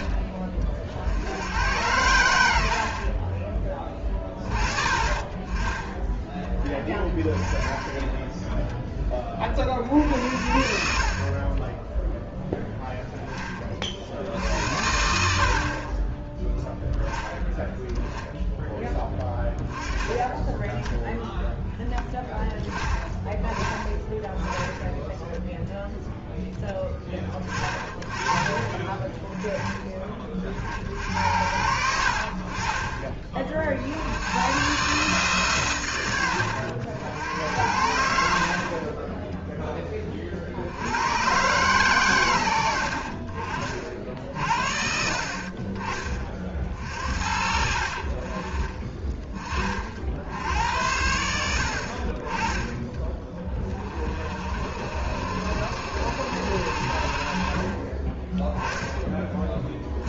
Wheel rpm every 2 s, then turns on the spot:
50, 50, 30, 20, 10, 50, 10, 80, 0, 10, 10, 20, 10, 10, 20, 60, 30, 130, 80, 30, 80, 70, 60, 50, 20, 70, 20, 60, 70, 10.
none